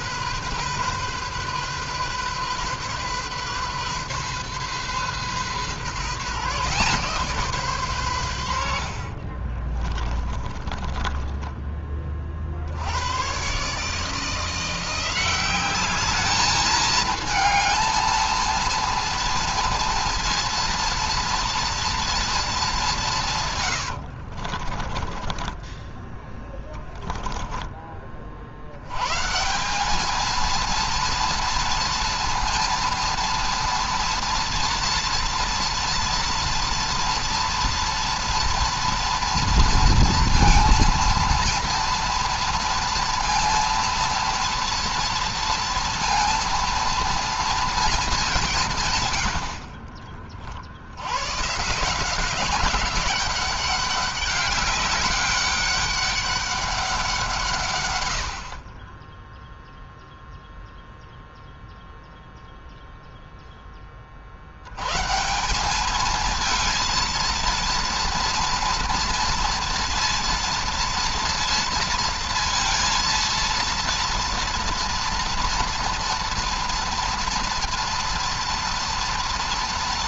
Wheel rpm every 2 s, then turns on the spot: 130, 130, 130, 140, 90, 30, 50, 160, 210, 230, 230, 210, 40, 10, 60, 230, 230, 230, 230, 230, 230, 230, 230, 230, 170, 50, 190, 200, 200, 50, 0, 0, 110, 220, 230, 230, 230, 230, 230, 230.
10-12 24-28